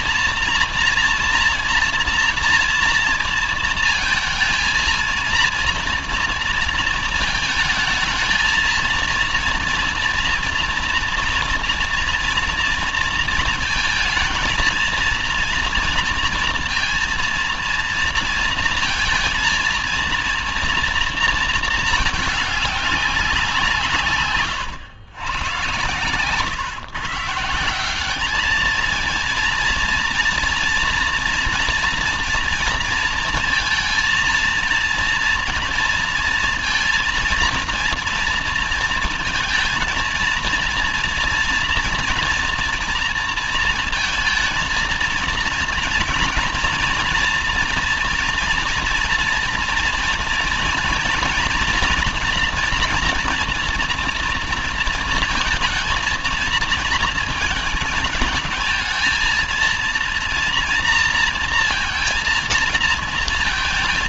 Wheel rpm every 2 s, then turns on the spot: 230, 230, 230, 220, 230, 230, 230, 230, 230, 230, 220, 190, 120, 160, 230, 230, 230, 230, 230, 230, 230, 230, 230, 230, 230, 240, 240, 230, 220, 220, 230, 230.
none